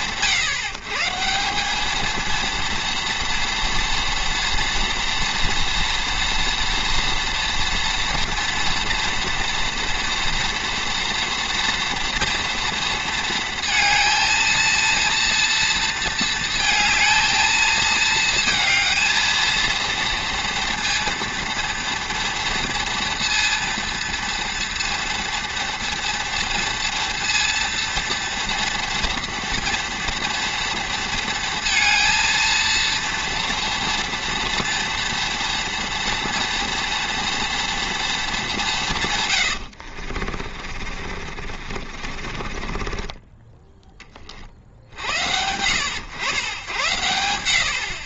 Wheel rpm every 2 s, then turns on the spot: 140, 230, 230, 230, 230, 240, 230, 230, 230, 230, 230, 230, 230, 230, 230, 230, 230, 230, 240, 190, 40, 30, 50, 90.
40-44